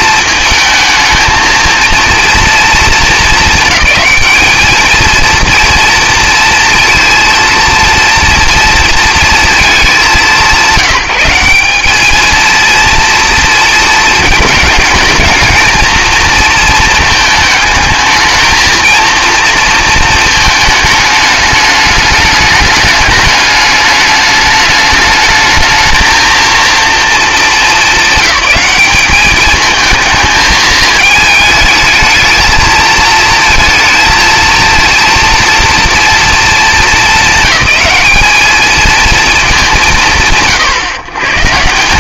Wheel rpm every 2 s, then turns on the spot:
230, 230, 220, 230, 230, 190, 230, 220, 230, 220, 220, 210, 210, 230, 200, 220, 220, 220, 220, 220, 110.
none